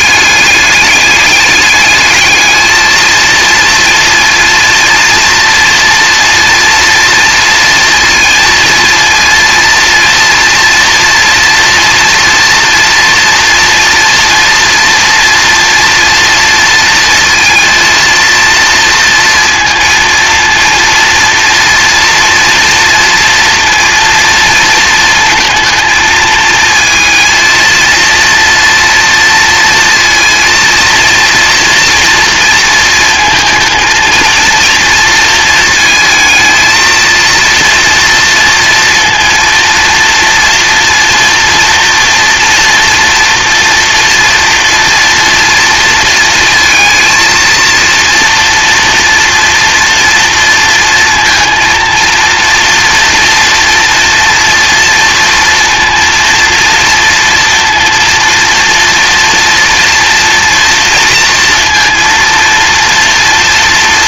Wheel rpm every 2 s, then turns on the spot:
200, 220, 230, 240, 230, 230, 240, 230, 230, 230, 230, 230, 230, 220, 230, 230, 230, 230, 230, 230, 230, 230, 230, 230, 230, 230, 230, 230, 230, 230, 240, 240.
none